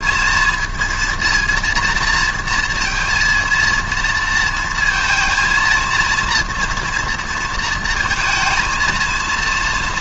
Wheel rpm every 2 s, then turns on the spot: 220, 230, 230, 230, 220.
none